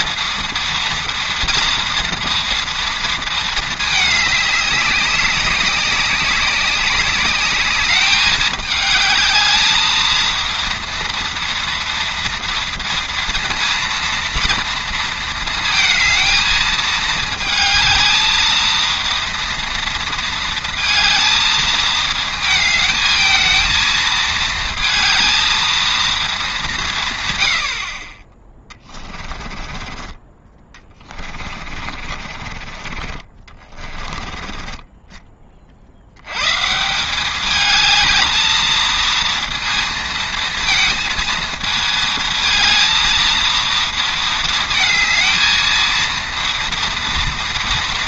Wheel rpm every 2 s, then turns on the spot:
230, 230, 200, 200, 220, 230, 230, 230, 220, 230, 230, 220, 220, 180, 20, 20, 40, 20, 160, 230, 220, 220, 220, 240.
28-32